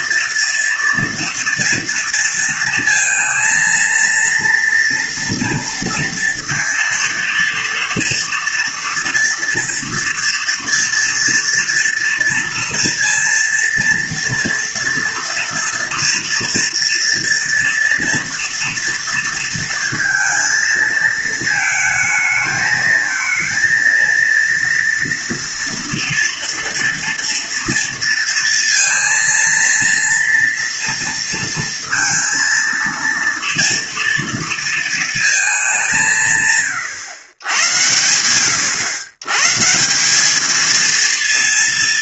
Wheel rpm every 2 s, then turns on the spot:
230, 230, 230, 230, 230, 230, 230, 230, 230, 230, 230, 220, 230, 230, 230, 230, 230, 230, 120, 130, 230.
none